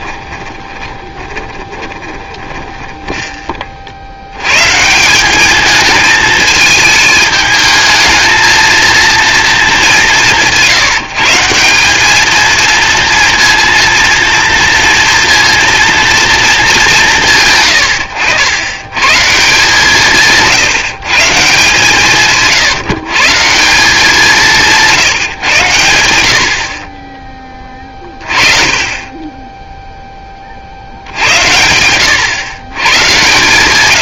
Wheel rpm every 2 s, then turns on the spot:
20, 20, 150, 220, 230, 170, 230, 230, 200, 110, 150, 150, 160, 40, 30, 60, 120.
0-4